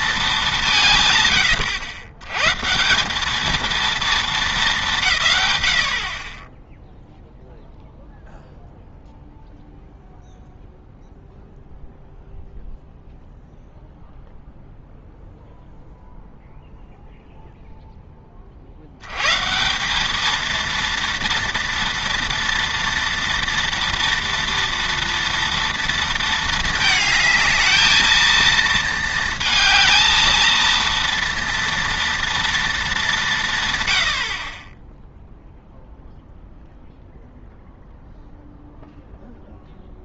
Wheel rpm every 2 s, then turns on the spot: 180, 140, 210, 10, 0, 0, 0, 0, 0, 50, 230, 230, 230, 220, 230, 230, 230, 40, 0, 0.
none